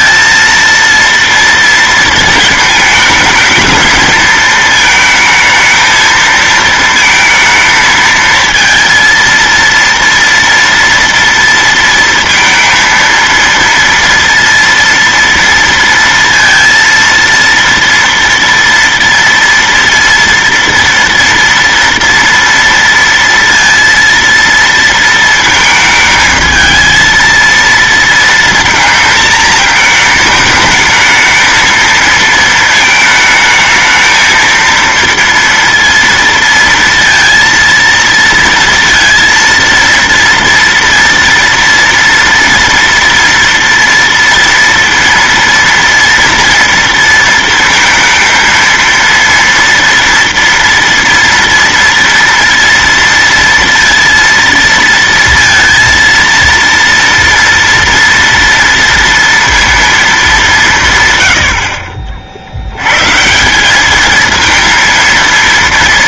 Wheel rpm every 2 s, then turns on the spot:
230, 220, 220, 220, 230, 230, 230, 230, 230, 230, 230, 230, 230, 230, 220, 220, 220, 230, 230, 230, 230, 230, 230, 230, 230, 230, 230, 230, 230, 230, 140, 130, 230.
none